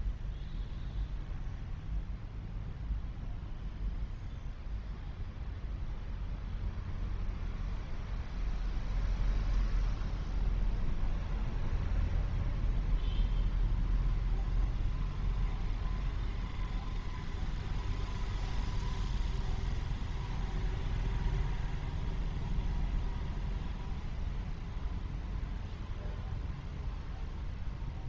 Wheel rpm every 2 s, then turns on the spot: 0, 0, 0, 0, 0, 0, 0, 0, 0, 0, 0, 0, 0, 0.
none